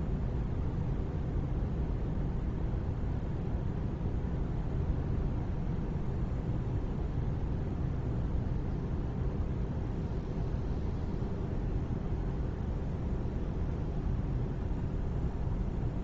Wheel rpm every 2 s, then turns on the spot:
0, 0, 0, 0, 0, 0, 0, 0.
none